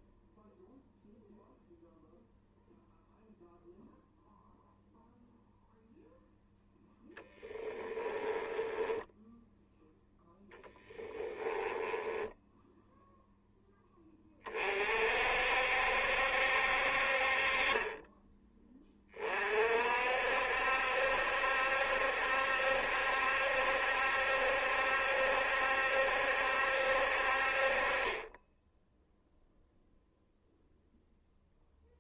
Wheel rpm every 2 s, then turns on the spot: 0, 0, 0, 0, 10, 10, 0, 50, 60, 20, 70, 70, 70, 60, 0, 0.
8-12